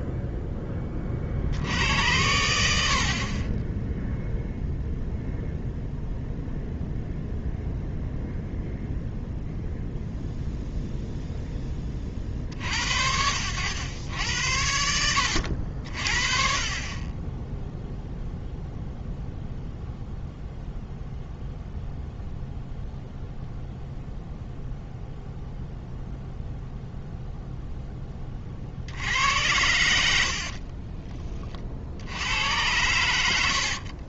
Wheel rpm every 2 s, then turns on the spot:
10, 90, 0, 0, 0, 0, 60, 80, 40, 0, 0, 0, 0, 0, 50, 50, 100.
30-32